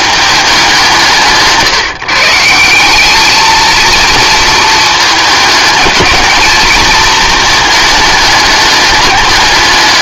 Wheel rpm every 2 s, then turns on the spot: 190, 180, 230, 220, 210.
none